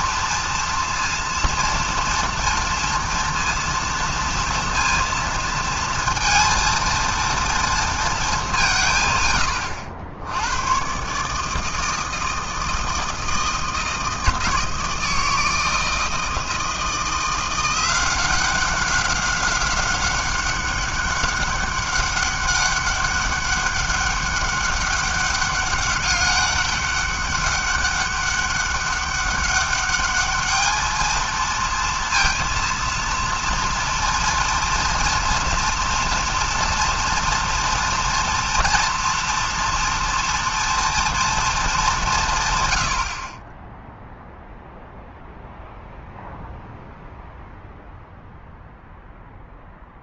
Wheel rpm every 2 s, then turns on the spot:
230, 230, 230, 230, 170, 110, 160, 160, 170, 190, 200, 200, 200, 200, 200, 210, 230, 230, 230, 230, 230, 100, 0, 0, 0.
none